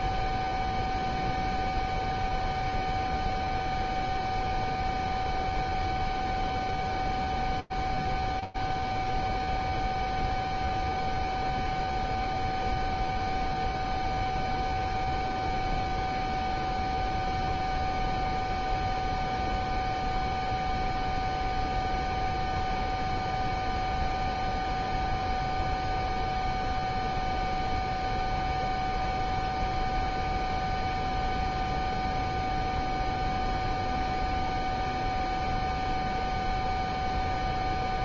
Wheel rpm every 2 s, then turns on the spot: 0, 0, 0, 0, 0, 0, 0, 0, 0, 0, 0, 0, 0, 0, 0, 0, 0, 0, 0.
none